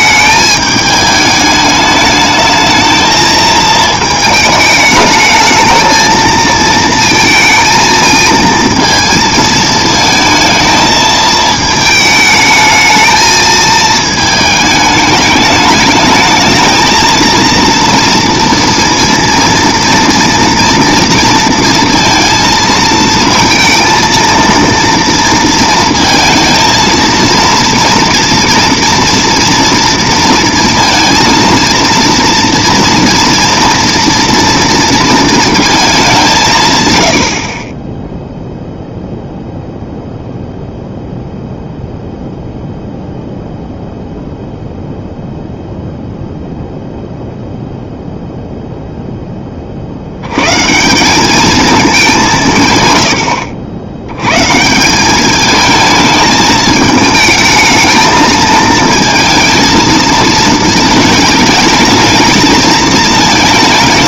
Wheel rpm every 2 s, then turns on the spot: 210, 220, 220, 230, 230, 220, 220, 210, 220, 230, 230, 230, 230, 230, 230, 230, 230, 230, 130, 0, 0, 0, 0, 0, 0, 160, 120, 160, 220, 220, 220, 220.
none